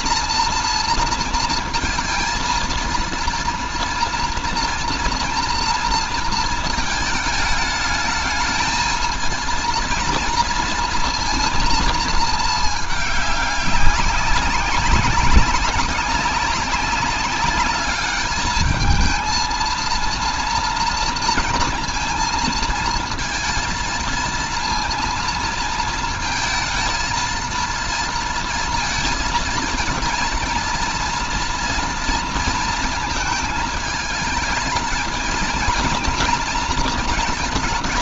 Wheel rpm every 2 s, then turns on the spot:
230, 230, 230, 220, 220, 230, 210, 190, 190, 210, 230, 230, 230, 230, 230, 230, 230, 220, 220.
none